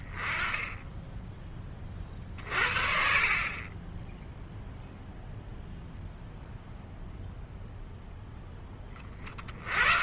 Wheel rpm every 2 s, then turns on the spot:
10, 50, 0, 0, 10.
none